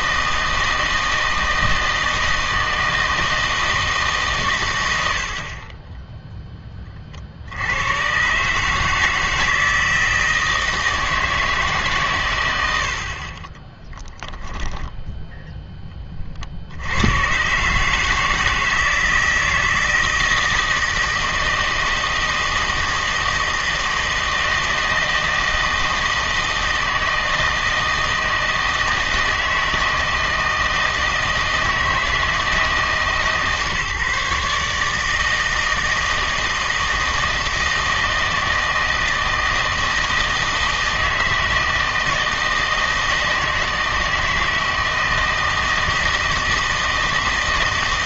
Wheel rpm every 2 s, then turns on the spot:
160, 160, 100, 20, 150, 160, 90, 10, 70, 160, 160, 160, 160, 160, 160, 160, 160, 150, 160, 160, 160, 160, 160, 160.
14-16